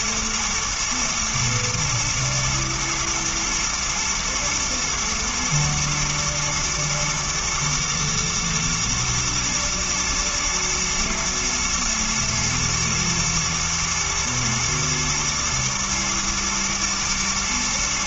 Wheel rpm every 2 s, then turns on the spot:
110, 110, 110, 120, 110, 110, 120, 110, 110.
none